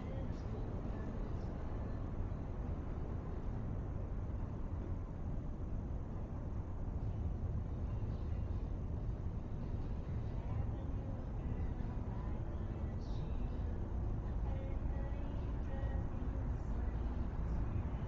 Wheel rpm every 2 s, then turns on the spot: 0, 0, 0, 0, 0, 0, 0, 0, 0.
none